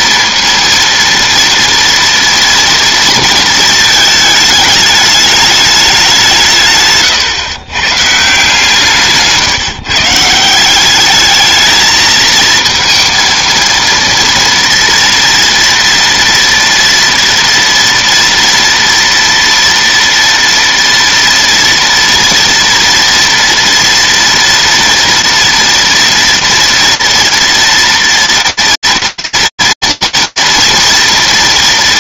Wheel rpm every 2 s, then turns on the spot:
230, 230, 210, 150, 150, 170, 230, 230, 230, 230, 230, 230, 230, 230, 230, 240.
none